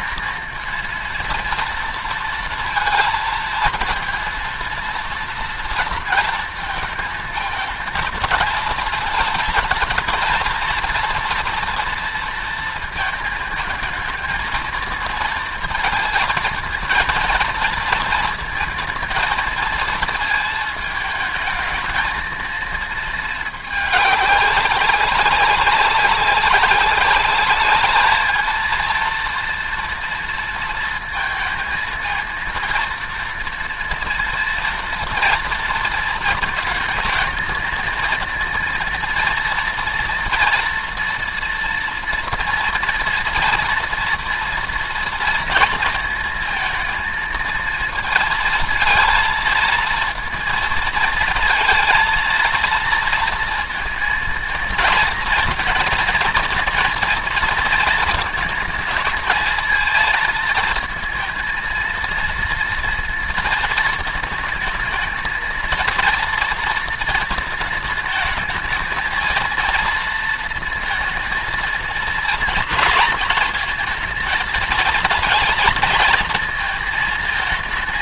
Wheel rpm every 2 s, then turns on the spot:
230, 230, 230, 230, 230, 230, 230, 220, 230, 230, 220, 230, 200, 200, 230, 230, 230, 230, 220, 230, 240, 230, 230, 220, 230, 230, 230, 230, 230, 220, 230, 230, 220, 230, 220, 230, 220, 220, 220.
none